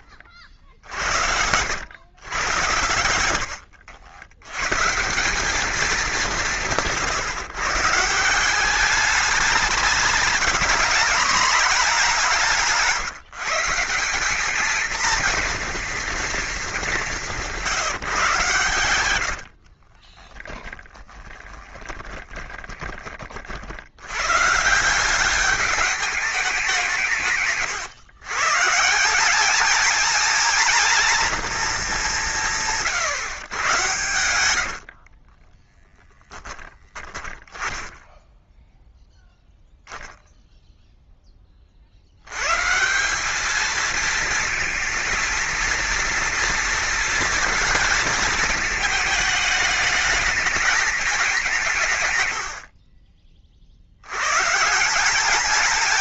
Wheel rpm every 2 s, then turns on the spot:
40, 100, 120, 160, 190, 210, 180, 220, 210, 110, 10, 20, 160, 180, 170, 230, 140, 60, 10, 0, 0, 140, 230, 230, 220, 220, 60, 160.
2-4 20-24 34-38